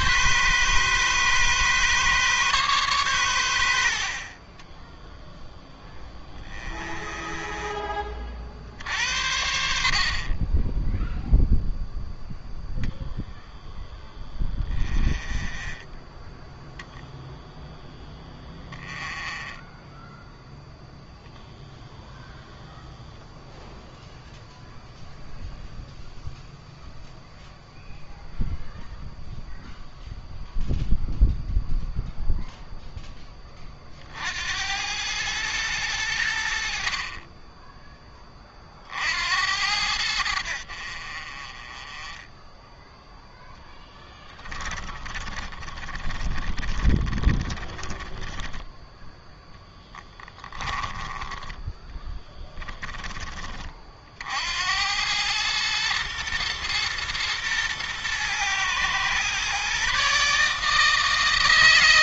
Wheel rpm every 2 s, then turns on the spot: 140, 130, 20, 20, 60, 10, 0, 20, 0, 10, 0, 0, 0, 0, 0, 0, 10, 90, 50, 50, 50, 0, 20, 30, 10, 20, 10, 90, 120, 120, 160.
4-8 14-16 18-20 44-48